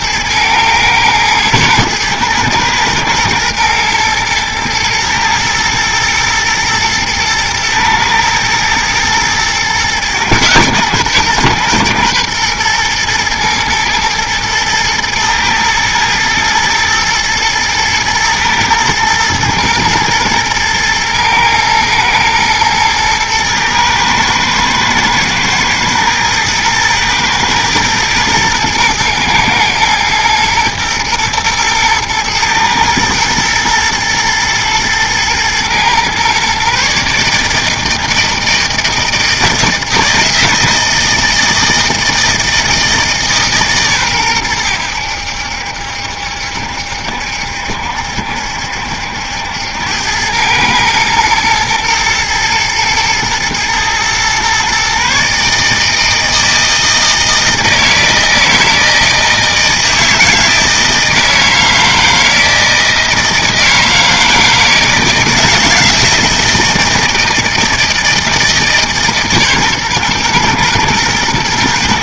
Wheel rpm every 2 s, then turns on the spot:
110, 110, 120, 110, 110, 120, 120, 110, 110, 110, 110, 110, 110, 110, 110, 120, 120, 110, 140, 160, 160, 160, 100, 70, 70, 110, 120, 130, 160, 160, 160, 160, 160, 160, 150, 110.
none